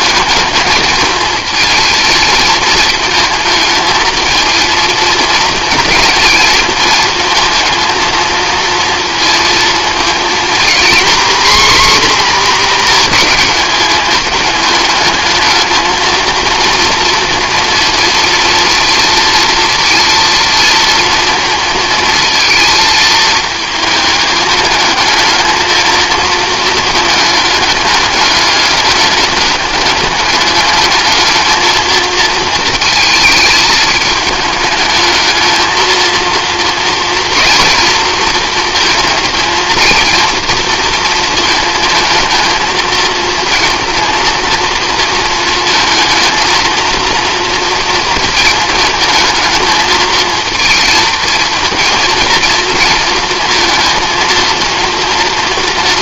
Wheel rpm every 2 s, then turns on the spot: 220, 220, 230, 230, 230, 240, 240, 210, 230, 230, 230, 230, 210, 220, 210, 210, 220, 210, 230, 230, 230, 220, 230, 230, 220, 220, 230, 230.
none